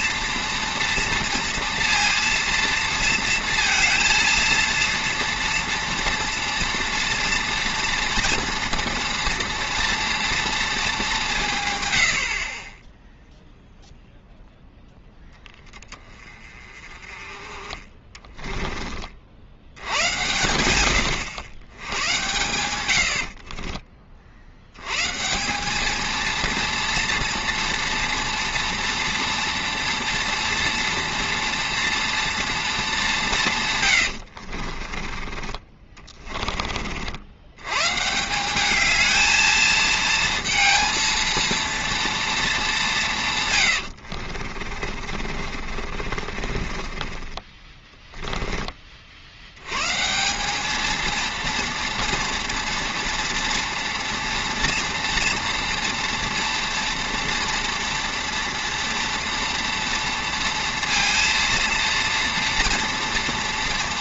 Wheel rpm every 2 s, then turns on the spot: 230, 230, 230, 230, 230, 230, 40, 0, 30, 20, 90, 90, 80, 230, 230, 230, 230, 60, 30, 200, 230, 210, 40, 40, 20, 210, 230, 230, 230, 230, 230, 230.
18-20 34-36 44-48